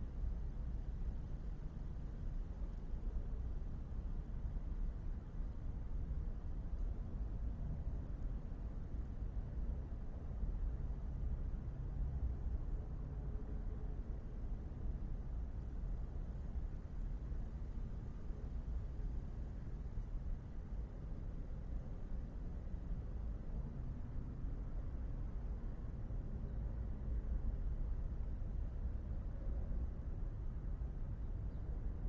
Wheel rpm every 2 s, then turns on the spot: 0, 0, 0, 0, 0, 0, 0, 0, 0, 0, 0, 0, 0, 0, 0, 0.
none